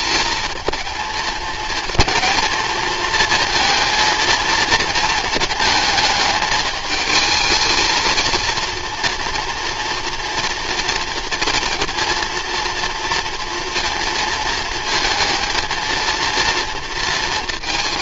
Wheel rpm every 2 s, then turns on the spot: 220, 230, 230, 220, 230, 230, 230, 220, 230.
none